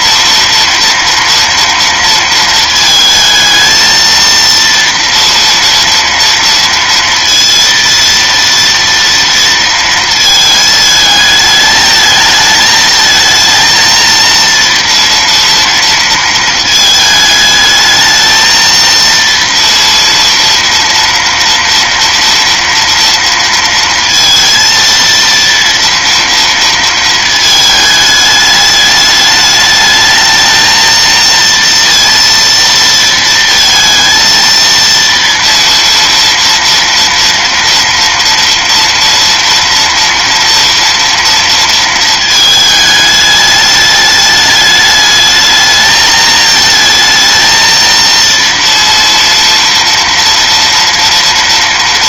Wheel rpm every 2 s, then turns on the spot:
230, 220, 230, 230, 230, 220, 220, 230, 220, 230, 230, 230, 230, 230, 210, 220, 230, 230, 230, 230, 230, 220, 210, 220, 230, 230.
none